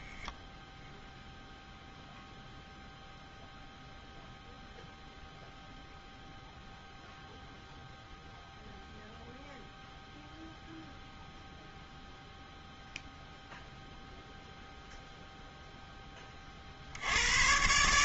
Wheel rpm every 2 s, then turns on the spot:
0, 0, 0, 0, 0, 0, 0, 0, 70.
none